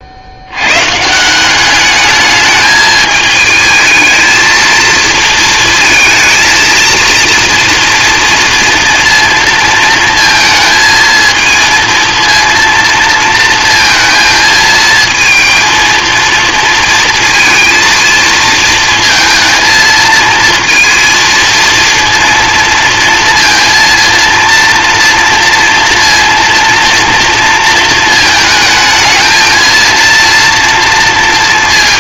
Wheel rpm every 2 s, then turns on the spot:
120, 220, 230, 230, 230, 220, 230, 220, 230, 230, 230, 230, 230, 230, 220, 230.
none